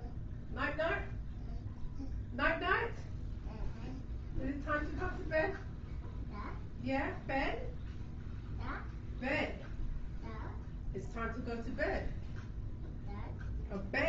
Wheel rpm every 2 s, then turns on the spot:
0, 0, 0, 0, 0, 0, 0.
none